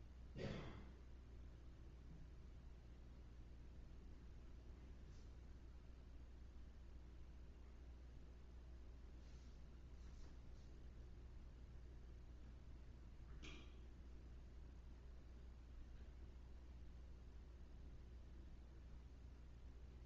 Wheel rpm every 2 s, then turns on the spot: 0, 0, 0, 0, 0, 0, 0, 0, 0, 0.
none